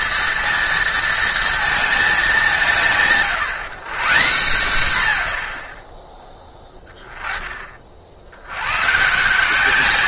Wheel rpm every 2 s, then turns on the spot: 230, 170, 120, 10, 110.
none